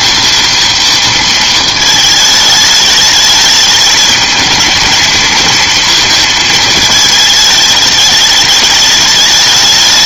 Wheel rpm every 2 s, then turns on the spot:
230, 210, 220, 220, 210.
none